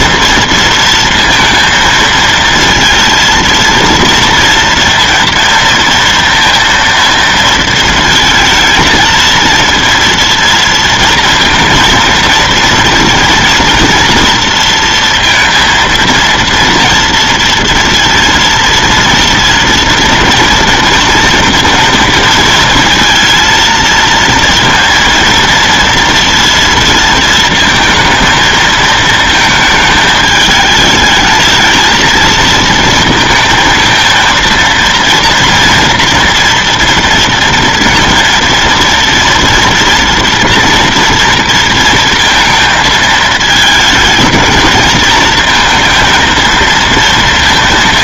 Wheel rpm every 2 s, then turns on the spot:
230, 230, 230, 230, 230, 230, 230, 230, 230, 230, 230, 230, 230, 230, 230, 220, 220, 230, 230, 230, 230, 230, 220, 230.
none